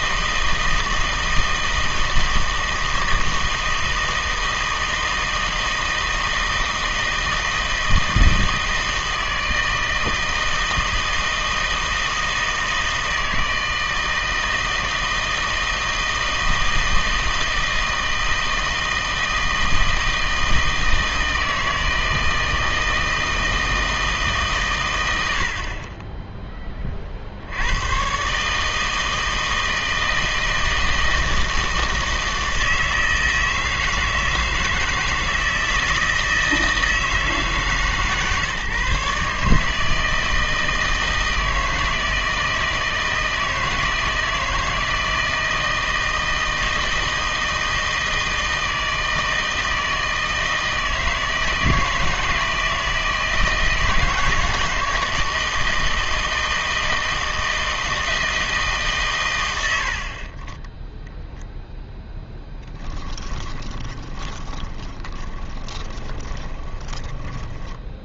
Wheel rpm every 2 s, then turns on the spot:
160, 160, 160, 160, 160, 160, 160, 160, 160, 160, 160, 160, 120, 30, 150, 160, 160, 160, 160, 140, 160, 160, 160, 160, 160, 160, 160, 160, 160, 150, 10, 10, 10, 20.
62-68